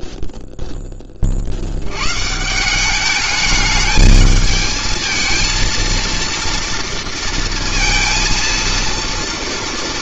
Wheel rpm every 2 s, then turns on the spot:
70, 210, 230, 230, 240.
none